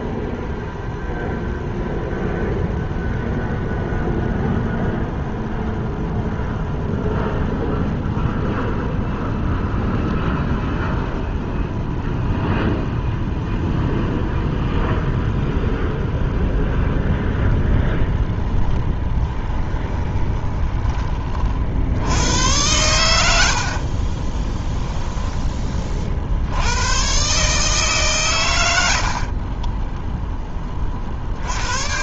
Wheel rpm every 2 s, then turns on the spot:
0, 0, 0, 0, 0, 0, 0, 0, 0, 20, 30, 100, 20, 100, 90, 30.
18-20